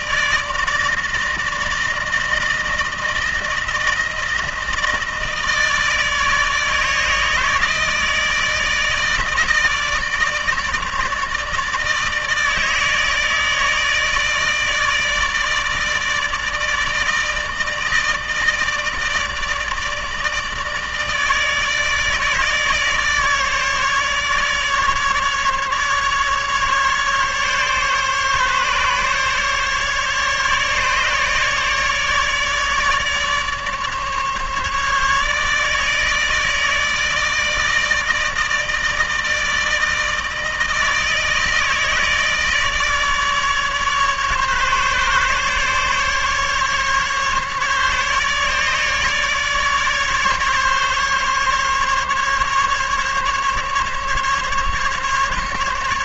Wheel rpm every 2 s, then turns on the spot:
160, 160, 160, 160, 160, 160, 160, 160, 160, 150, 150, 150, 150, 140, 140, 150, 150, 150, 160, 160, 160, 150, 140, 150, 150, 140, 140, 140.
none